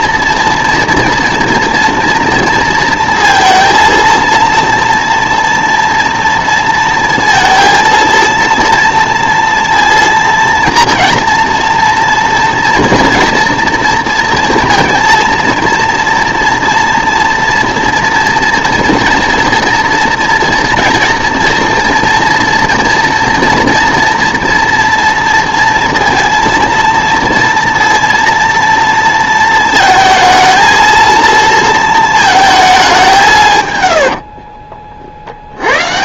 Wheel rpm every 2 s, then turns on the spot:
230, 230, 230, 230, 230, 230, 230, 230, 230, 230, 230, 230, 230, 230, 230, 220, 210, 40.
34-36